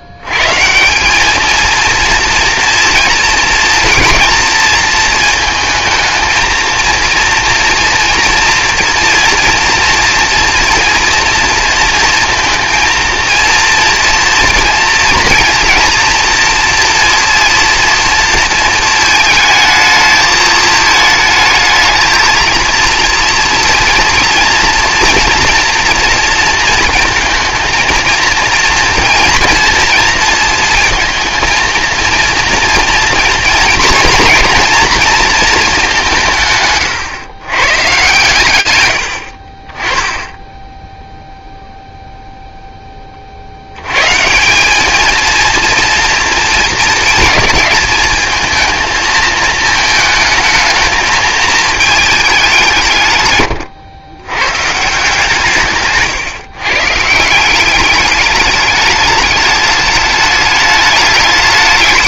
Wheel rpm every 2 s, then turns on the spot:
100, 230, 230, 230, 230, 240, 230, 230, 230, 230, 220, 230, 230, 230, 230, 230, 240, 230, 140, 90, 10, 0, 190, 220, 220, 220, 180, 140, 140, 210, 210.
none